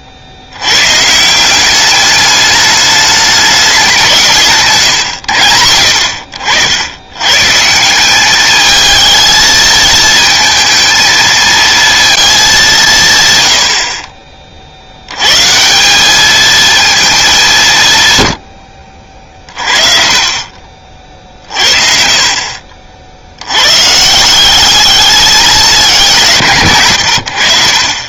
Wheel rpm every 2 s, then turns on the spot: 100, 210, 150, 70, 210, 220, 200, 50, 220, 90, 40, 40, 190, 150.
none